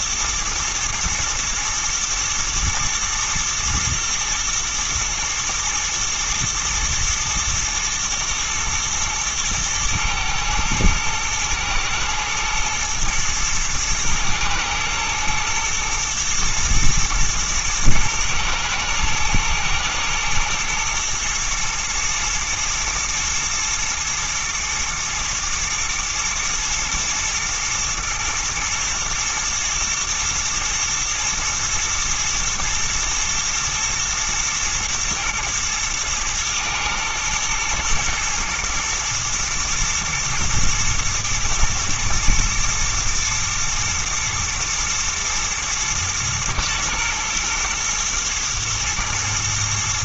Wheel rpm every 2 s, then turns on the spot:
110, 120, 120, 110, 110, 120, 120, 110, 110, 120, 110, 120, 120, 110, 120, 110, 120, 110, 110, 110, 110, 120, 110, 110, 110.
none